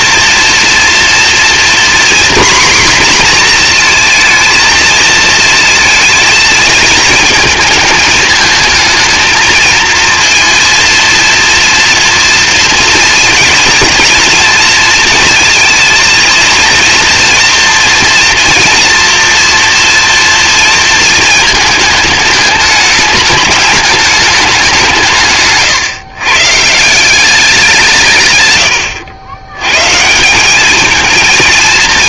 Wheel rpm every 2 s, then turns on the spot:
230, 250, 230, 220, 220, 230, 230, 230, 230, 230, 230, 210, 190, 150, 100, 210.
none